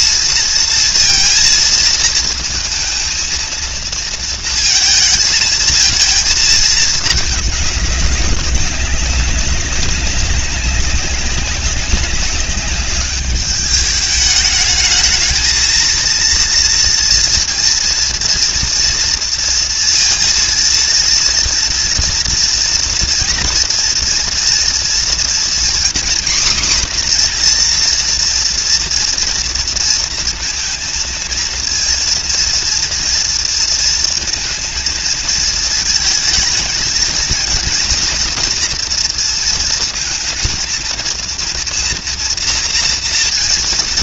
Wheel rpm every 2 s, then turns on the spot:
230, 220, 230, 220, 200, 200, 200, 210, 230, 240, 230, 230, 230, 260, 230, 230, 230, 230, 220, 230, 230, 230.
none